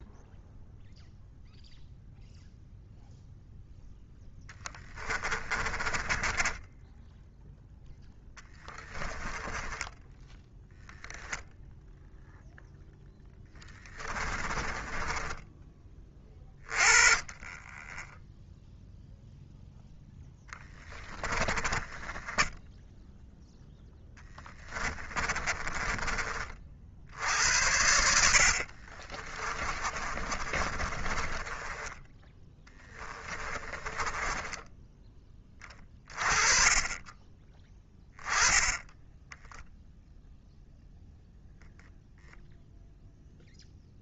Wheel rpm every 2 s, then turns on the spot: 0, 0, 10, 10, 10, 0, 0, 20, 20, 0, 10, 0, 10, 50, 50, 30, 10, 10, 20, 10, 0, 0.
4-6 8-10 14-16 20-22 24-26 28-36